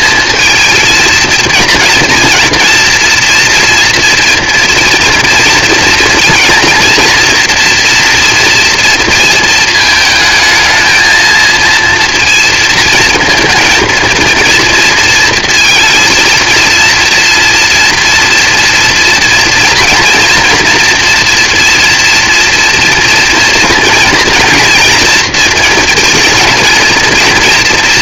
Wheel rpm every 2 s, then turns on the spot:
230, 230, 230, 240, 230, 220, 230, 230, 230, 230, 230, 230, 240, 230.
none